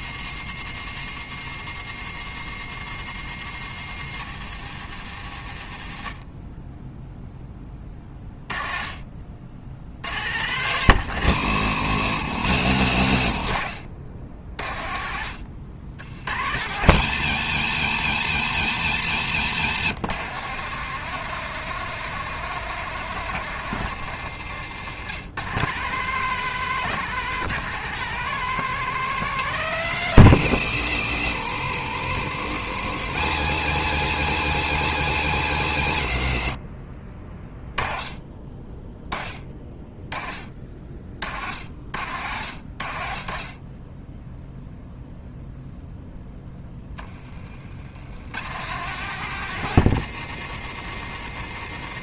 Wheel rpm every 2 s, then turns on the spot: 130, 120, 100, 0, 30, 110, 60, 50, 110, 110, 160, 160, 130, 170, 170, 80, 90, 110, 30, 20, 50, 60, 0, 20, 140, 120.
24-26